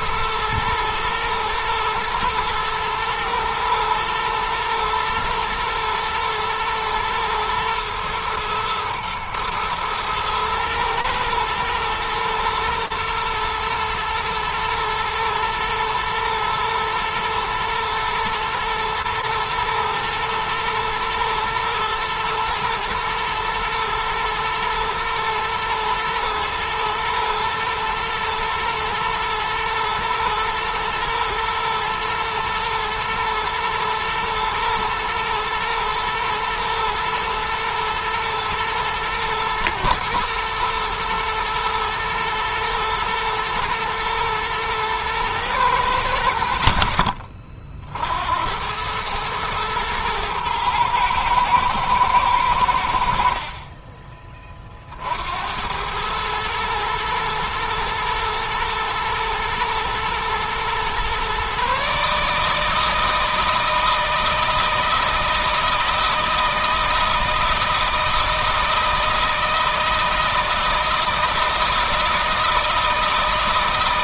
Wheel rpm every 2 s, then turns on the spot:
110, 120, 110, 110, 110, 110, 120, 110, 120, 110, 110, 120, 110, 120, 120, 110, 110, 110, 110, 110, 120, 110, 110, 50, 100, 110, 80, 50, 110, 110, 120, 160, 160, 160, 160, 160, 160.
none